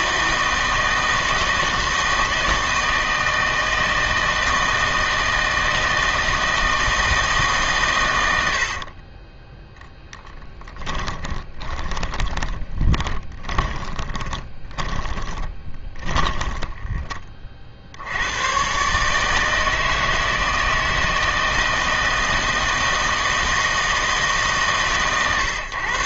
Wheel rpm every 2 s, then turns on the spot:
160, 160, 160, 160, 60, 20, 20, 20, 10, 130, 160, 160, 140.
8-18